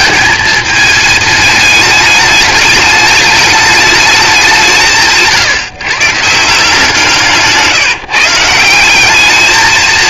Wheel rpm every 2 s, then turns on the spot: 220, 210, 170, 170, 170.
none